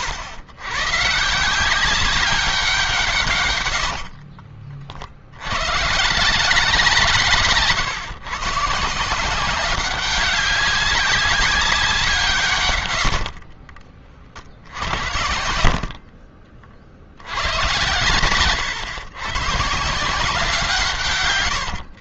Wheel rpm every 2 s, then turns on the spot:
120, 180, 50, 170, 140, 200, 130, 60, 40, 110, 160.
18-20